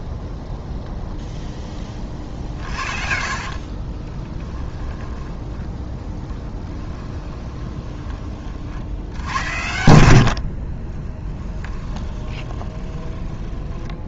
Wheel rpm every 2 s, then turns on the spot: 0, 40, 10, 10, 80, 30, 20.
2-4 6-8 10-14